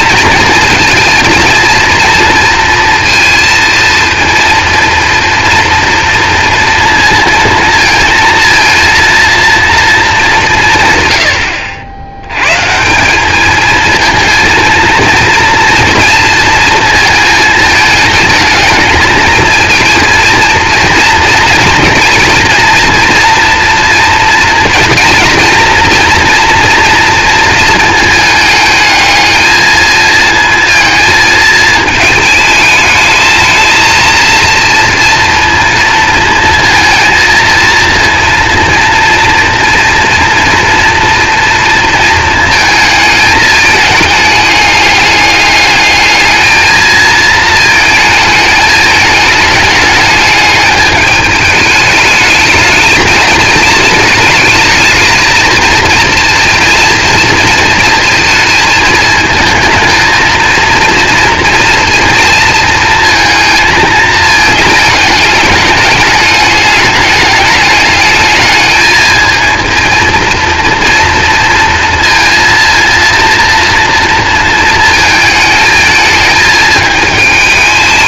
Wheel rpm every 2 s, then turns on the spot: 230, 230, 230, 230, 230, 150, 150, 230, 220, 220, 230, 230, 230, 230, 210, 230, 220, 230, 230, 230, 230, 220, 210, 220, 220, 210, 220, 220, 230, 220, 230, 230, 220, 210, 220, 230, 230, 220, 220.
none